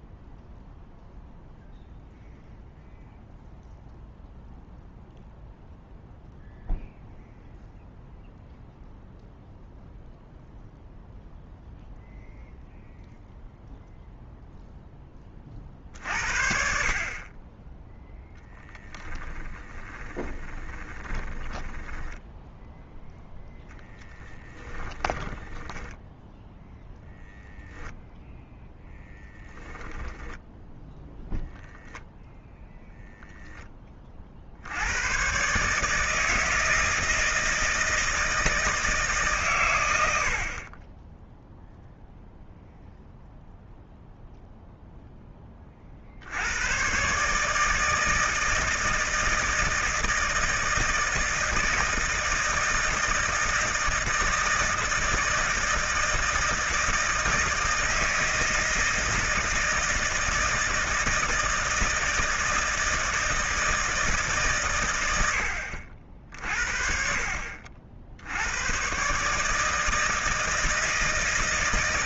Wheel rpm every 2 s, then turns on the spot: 0, 0, 0, 0, 0, 0, 0, 10, 40, 10, 20, 0, 20, 0, 10, 0, 0, 100, 160, 150, 20, 0, 0, 120, 160, 160, 160, 160, 160, 160, 160, 160, 100, 50, 130, 160.
18-22 24-26